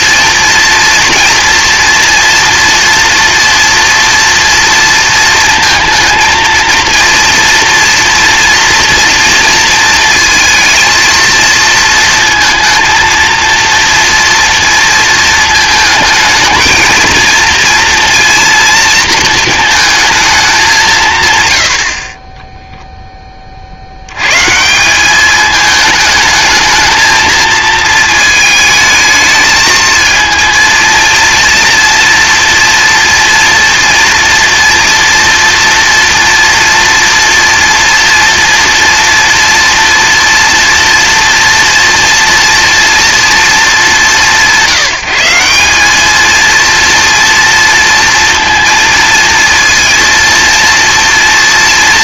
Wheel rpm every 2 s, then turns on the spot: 230, 230, 230, 230, 240, 230, 230, 230, 220, 230, 190, 0, 170, 220, 220, 230, 240, 230, 230, 230, 240, 240, 180, 230, 230, 230.
none